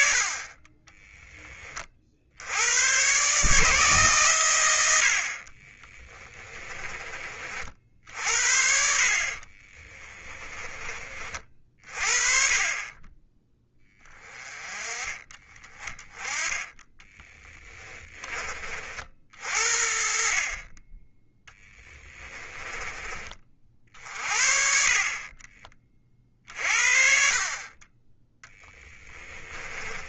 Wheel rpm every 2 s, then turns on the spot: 20, 130, 80, 30, 50, 30, 20, 20, 20, 50, 20, 20, 40, 50, 10.
28-30